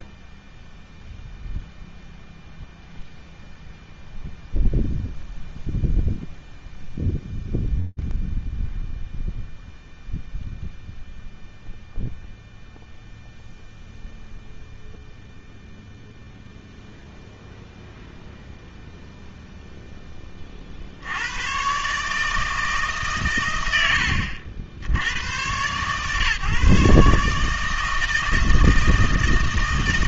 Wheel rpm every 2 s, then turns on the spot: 0, 0, 0, 0, 0, 0, 0, 0, 0, 0, 50, 150, 90, 140, 160.
none